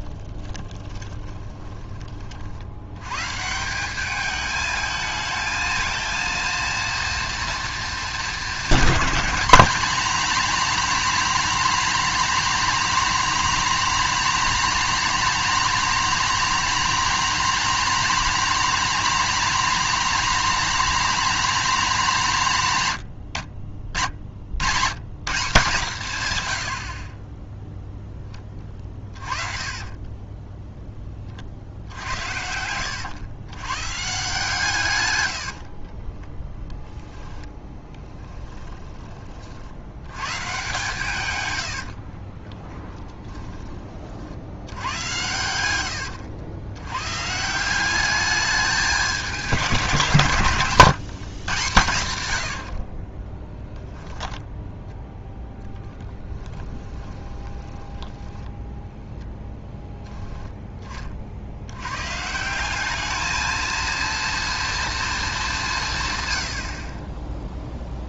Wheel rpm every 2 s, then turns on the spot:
20, 100, 220, 230, 220, 250, 250, 250, 250, 250, 250, 150, 110, 70, 30, 10, 90, 130, 10, 20, 140, 10, 90, 100, 210, 150, 60, 0, 10, 10, 20, 190, 230, 50.
0-2 28-30 38-40 42-44 56-58